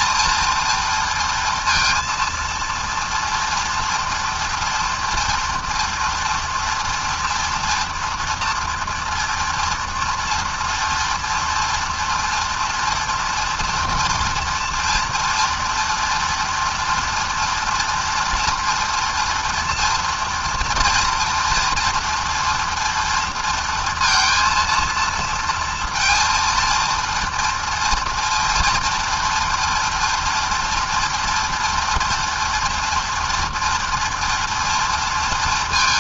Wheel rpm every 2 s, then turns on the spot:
230, 230, 230, 230, 240, 230, 230, 230, 230, 230, 230, 230, 230, 230, 230, 230, 240, 230.
none